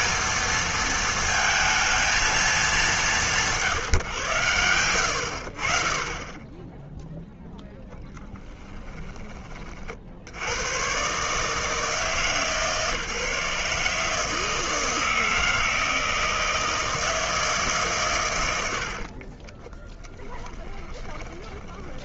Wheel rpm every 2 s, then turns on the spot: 230, 160, 60, 0, 30, 150, 150, 160, 150, 30, 20.
18-22